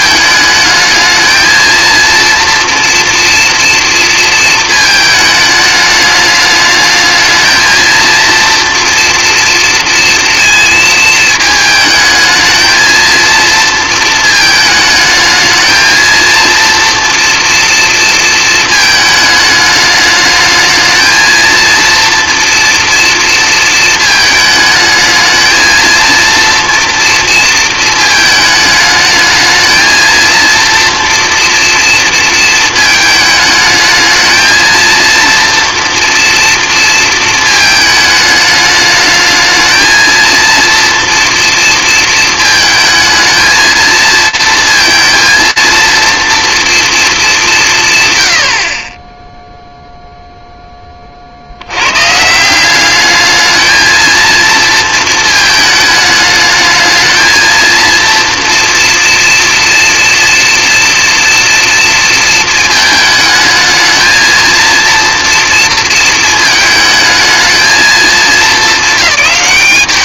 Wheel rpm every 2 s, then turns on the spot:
220, 230, 220, 210, 230, 220, 220, 220, 230, 220, 220, 240, 220, 230, 210, 230, 220, 230, 230, 210, 230, 220, 230, 230, 30, 30, 210, 220, 220, 240, 230, 220, 240, 220, 210.
none